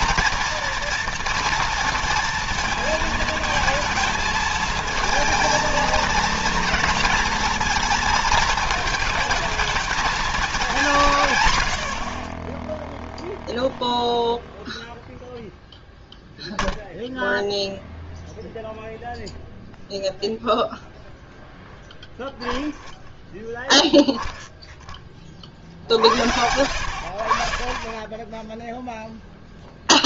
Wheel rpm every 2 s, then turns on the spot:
230, 230, 220, 230, 220, 200, 30, 0, 10, 0, 0, 0, 0, 60, 10.
none